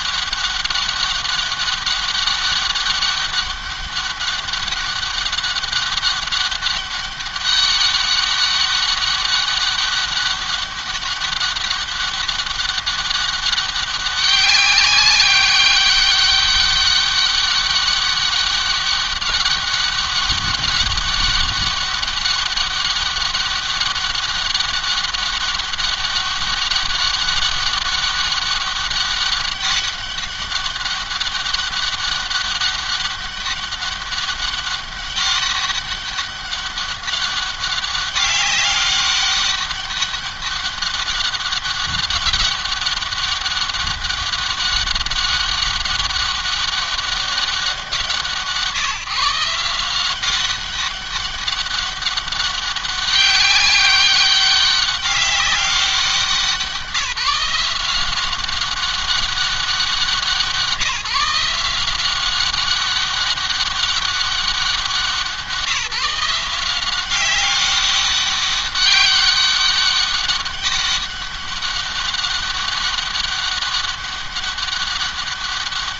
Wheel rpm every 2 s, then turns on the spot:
200, 200, 190, 200, 200, 200, 200, 190, 200, 200, 200, 200, 200, 200, 200, 200, 190, 200, 200, 200, 200, 200, 200, 200, 160, 190, 200, 200, 170, 190, 180, 190, 180, 180, 200, 200, 200, 200.
none